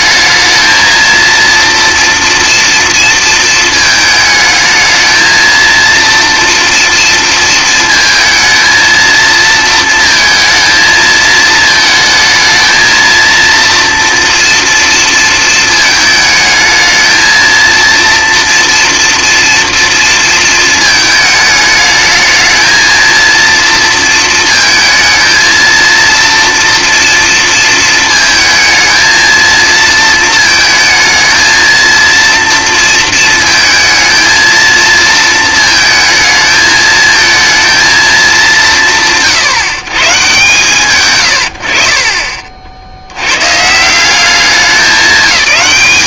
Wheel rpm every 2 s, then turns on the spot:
220, 230, 220, 240, 220, 230, 230, 230, 220, 230, 220, 220, 220, 230, 220, 220, 230, 220, 220, 180, 130, 60, 190.
none